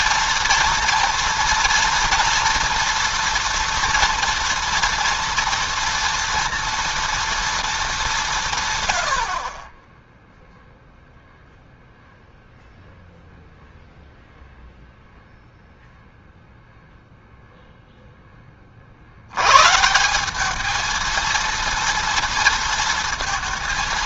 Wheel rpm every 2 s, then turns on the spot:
230, 230, 230, 230, 110, 0, 0, 0, 0, 40, 220, 230.
none